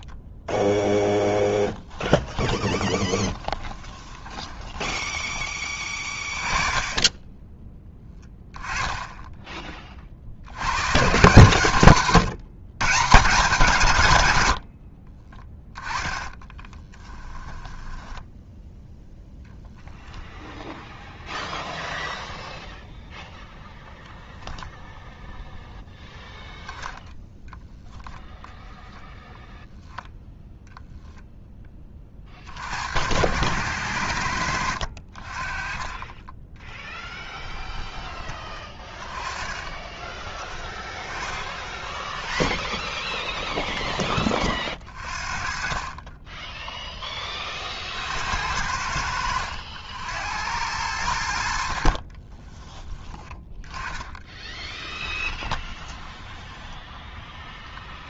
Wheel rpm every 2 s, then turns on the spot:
20, 20, 20, 20, 10, 120, 150, 40, 20, 10, 0, 0, 0, 0, 0, 0, 70, 60, 10, 20, 10, 10, 40, 10, 70, 90, 10, 10, 10.
0-6 16-20 36-40 48-50 52-56